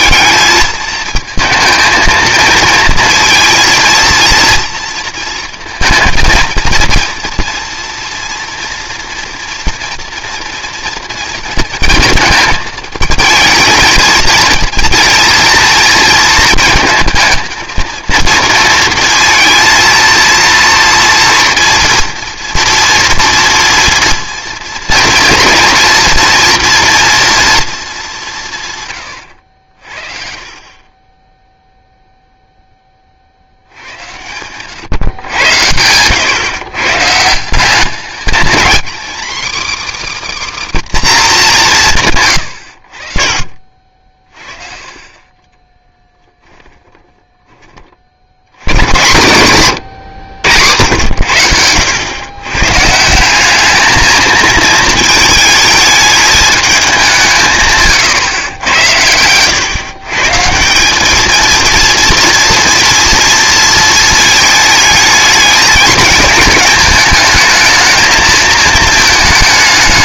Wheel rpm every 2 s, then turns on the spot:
220, 230, 230, 230, 230, 240, 220, 230, 230, 230, 230, 230, 230, 230, 150, 40, 10, 130, 140, 240, 280, 80, 40, 20, 110, 80, 130, 220, 210, 100, 190, 240, 220, 210, 220.
46-48